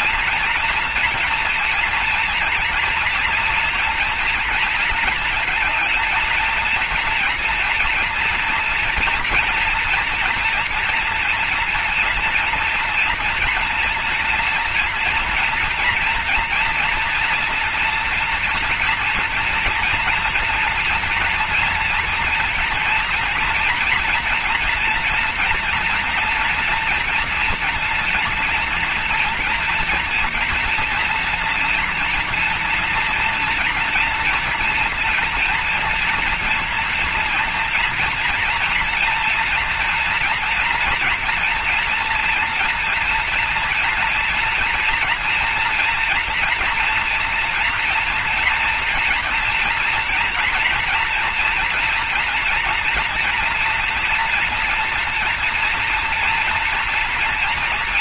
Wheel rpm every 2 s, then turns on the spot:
230, 230, 230, 230, 230, 230, 230, 240, 230, 230, 230, 230, 230, 230, 230, 230, 230, 230, 230, 230, 230, 240, 240, 230, 230, 230, 240, 230, 230.
none